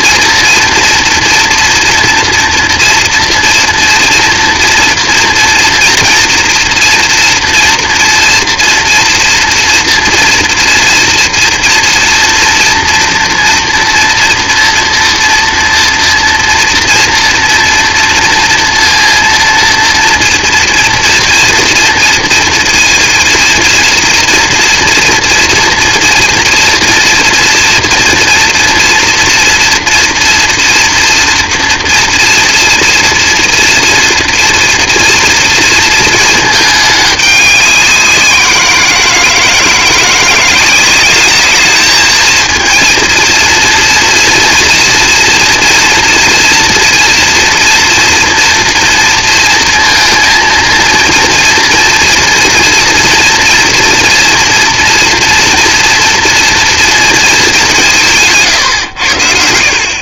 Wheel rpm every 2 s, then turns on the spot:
230, 240, 240, 230, 230, 230, 230, 230, 240, 230, 230, 230, 240, 230, 230, 240, 230, 230, 210, 170, 190, 230, 240, 230, 230, 230, 230, 230, 230, 130.
none